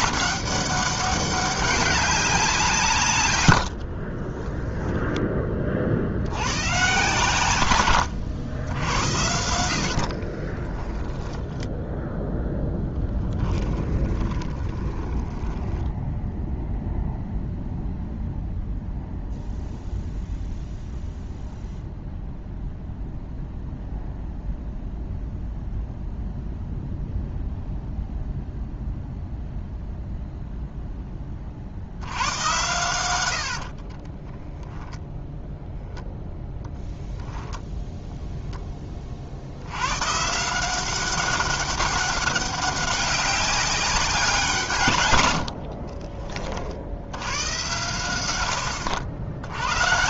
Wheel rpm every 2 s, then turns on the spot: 200, 150, 10, 130, 80, 10, 10, 20, 0, 0, 0, 0, 0, 0, 0, 10, 110, 0, 0, 20, 180, 200, 140, 70, 80.
10-16 32-34